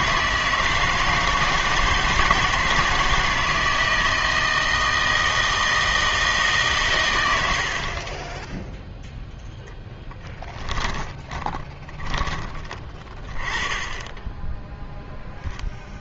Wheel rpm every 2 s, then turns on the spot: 160, 170, 160, 140, 0, 10, 20, 10.
10-12